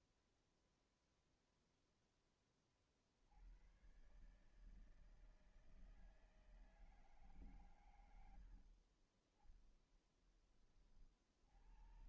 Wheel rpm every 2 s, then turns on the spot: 0, 70, 160, 150, 40, 70.
none